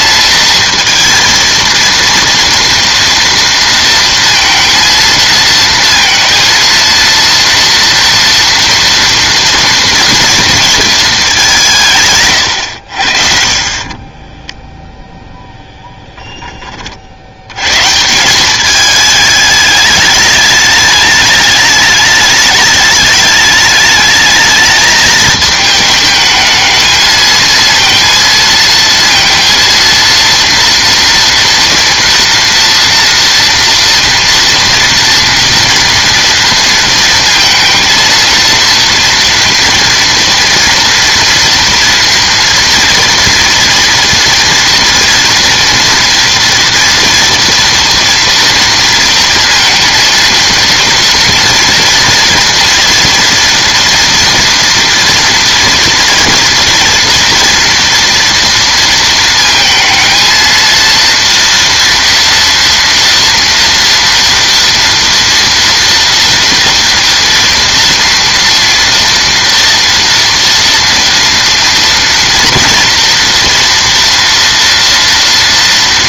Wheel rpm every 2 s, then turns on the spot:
230, 230, 230, 230, 230, 230, 90, 10, 30, 200, 210, 210, 220, 220, 230, 240, 240, 230, 230, 230, 240, 230, 240, 240, 230, 230, 230, 230, 230, 230, 230, 230, 230, 230, 230, 230, 230, 230.
14-16